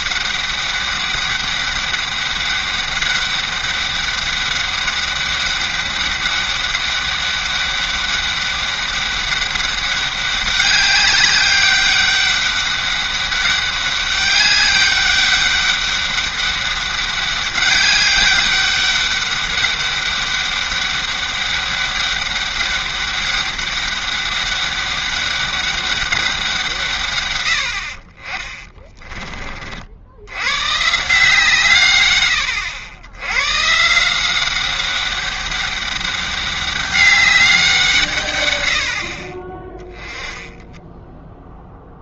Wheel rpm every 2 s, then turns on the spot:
200, 200, 200, 200, 200, 200, 200, 200, 200, 200, 200, 200, 200, 160, 20, 130, 90, 190, 200, 90, 10.
40-42